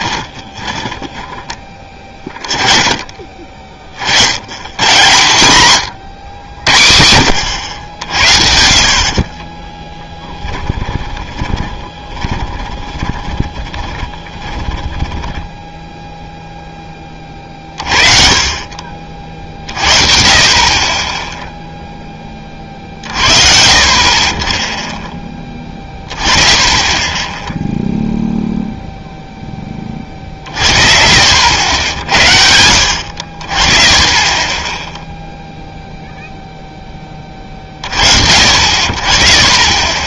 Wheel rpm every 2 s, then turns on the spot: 20, 30, 130, 90, 30, 20, 20, 10, 30, 40, 10, 40, 20, 10, 0, 60, 50, 0, 20, 30.
0-2 8-16